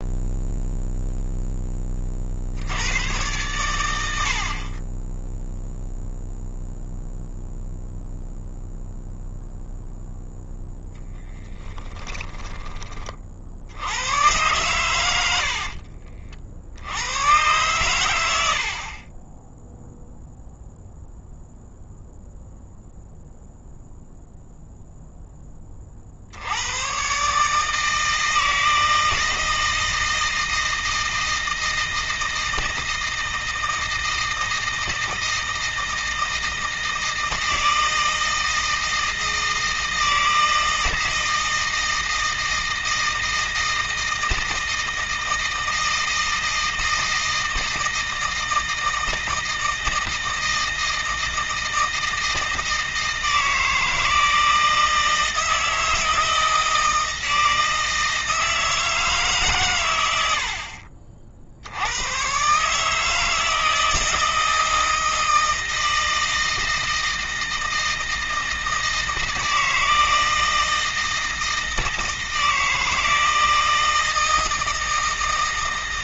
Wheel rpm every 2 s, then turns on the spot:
0, 100, 20, 0, 0, 0, 30, 90, 90, 40, 0, 0, 0, 120, 160, 160, 160, 160, 160, 160, 160, 160, 160, 160, 160, 160, 160, 160, 160, 150, 50, 150, 160, 160, 160, 160, 160, 160.
14-16